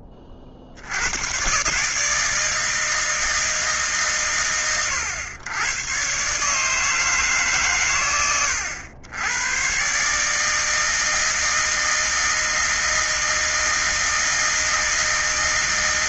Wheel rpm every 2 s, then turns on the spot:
50, 160, 100, 140, 80, 160, 160, 160.
none